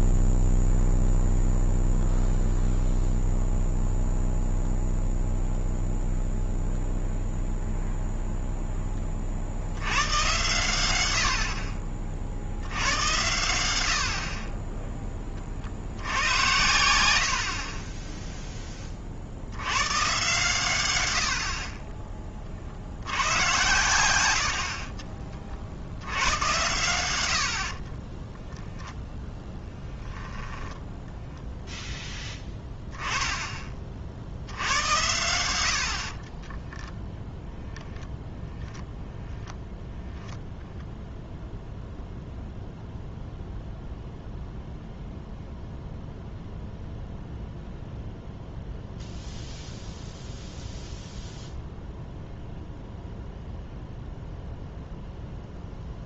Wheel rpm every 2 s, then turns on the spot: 0, 0, 0, 0, 0, 100, 80, 20, 100, 20, 100, 60, 50, 100, 0, 10, 10, 80, 10, 10, 10, 0, 0, 0, 0, 0, 0, 0.
36-38